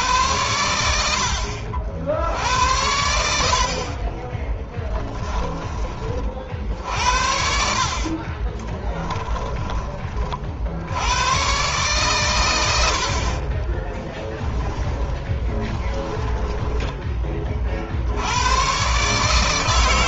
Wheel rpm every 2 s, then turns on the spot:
80, 70, 10, 60, 20, 90, 70, 20, 20, 130.
4-6 8-10 14-16